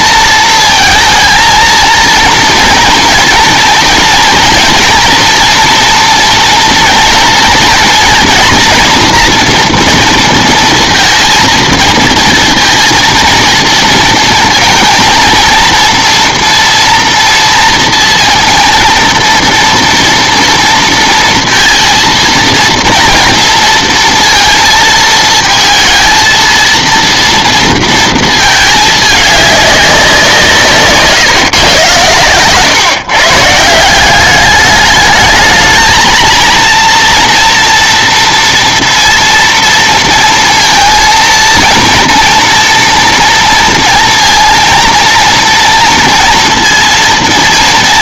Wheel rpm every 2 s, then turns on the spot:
220, 230, 230, 240, 240, 230, 230, 220, 230, 230, 230, 230, 230, 230, 220, 150, 130, 200, 230, 230, 230, 230, 230, 230.
none